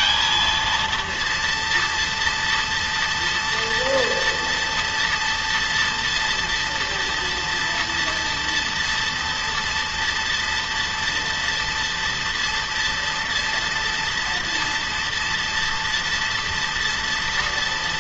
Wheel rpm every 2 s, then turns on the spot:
230, 230, 240, 230, 230, 230, 230, 230, 230.
none